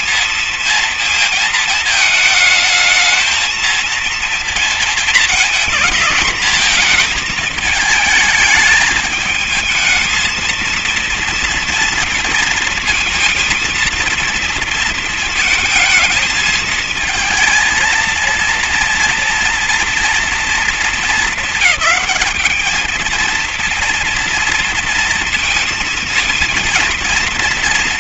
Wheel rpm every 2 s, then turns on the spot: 220, 220, 230, 220, 220, 230, 230, 230, 230, 230, 200, 220, 230, 230.
none